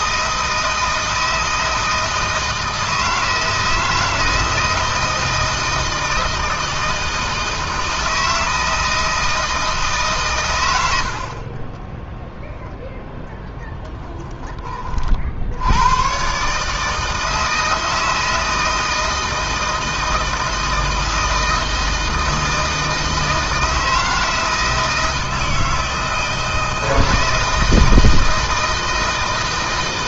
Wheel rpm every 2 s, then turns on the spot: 160, 160, 160, 160, 160, 70, 0, 40, 160, 160, 160, 160, 160, 160, 160.
none